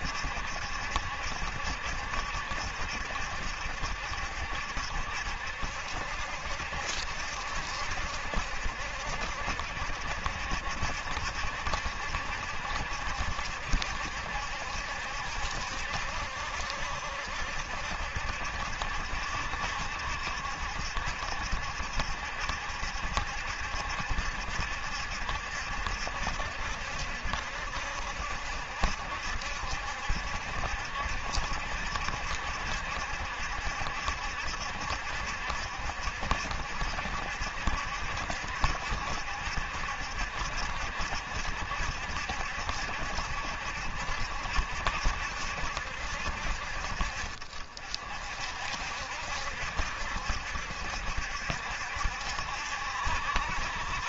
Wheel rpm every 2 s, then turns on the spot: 70, 70, 70, 70, 70, 60, 70, 70, 70, 70, 70, 70, 70, 70, 70, 70, 70, 70, 70, 70, 70, 70, 70, 50, 60, 70, 70.
none